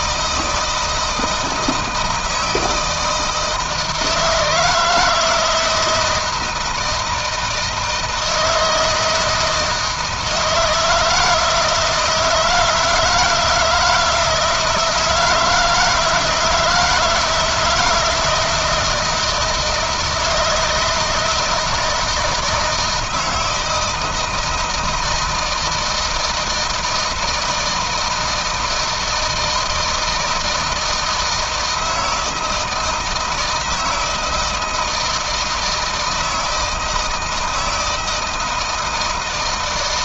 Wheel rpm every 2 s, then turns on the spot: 160, 160, 160, 160, 160, 160, 160, 170, 170, 160, 160, 160, 160, 160, 160, 160, 160, 160, 160, 160.
none